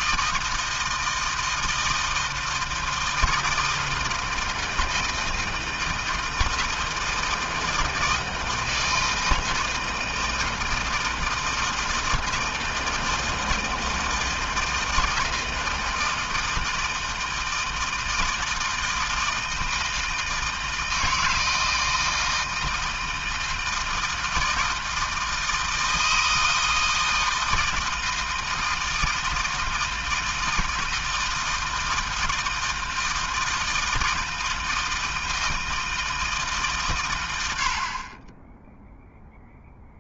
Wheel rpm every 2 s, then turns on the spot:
160, 160, 160, 160, 160, 160, 160, 160, 160, 160, 160, 160, 160, 160, 160, 160, 160, 160, 110, 0.
none